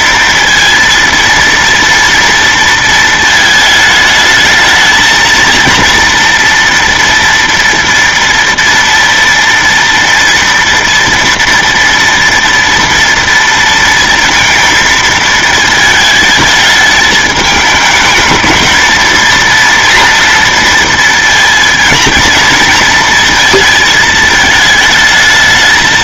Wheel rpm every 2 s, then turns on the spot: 230, 230, 220, 240, 240, 230, 230, 220, 220, 220, 230, 230, 220.
none